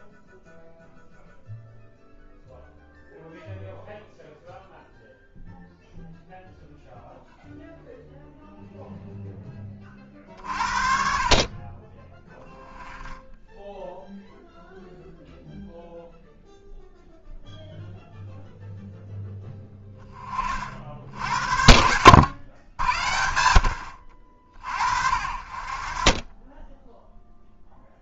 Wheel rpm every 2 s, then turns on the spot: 0, 0, 0, 0, 0, 50, 10, 0, 0, 0, 50, 90, 50, 10.
none